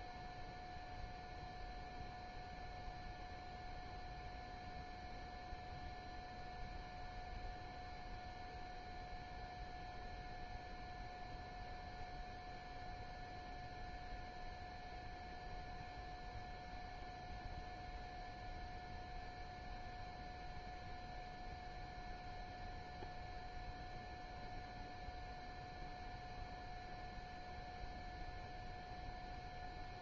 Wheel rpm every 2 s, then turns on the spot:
0, 0, 0, 0, 0, 0, 0, 0, 0, 0, 0, 0, 0, 0, 0.
none